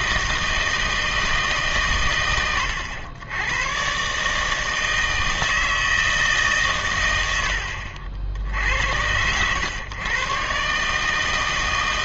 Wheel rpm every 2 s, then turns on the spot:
160, 90, 160, 130, 70, 140.
none